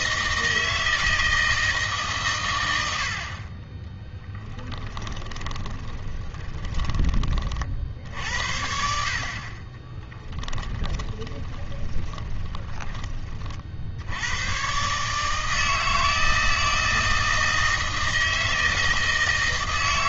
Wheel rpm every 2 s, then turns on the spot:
160, 100, 20, 20, 70, 10, 20, 110, 160, 160.
4-8 10-14